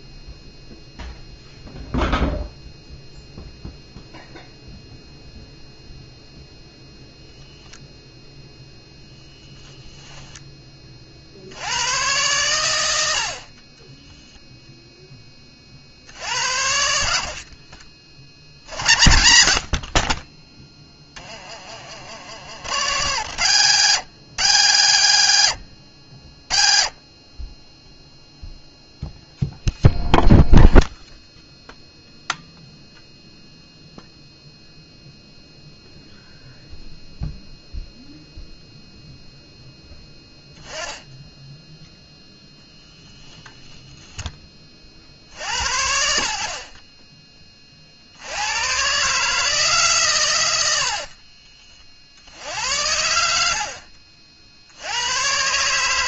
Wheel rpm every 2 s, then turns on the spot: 0, 0, 0, 0, 0, 20, 120, 0, 70, 60, 10, 60, 70, 20, 0, 0, 0, 0, 0, 0, 10, 0, 30, 40, 130, 80, 90, 110.
20-22 46-48 50-52